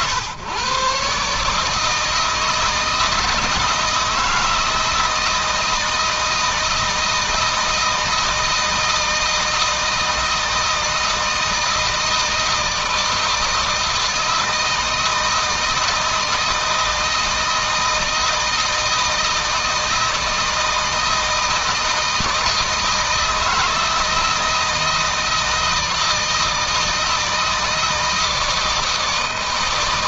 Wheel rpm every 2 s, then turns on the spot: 130, 160, 160, 160, 160, 160, 160, 160, 160, 160, 160, 160, 160, 160, 160.
none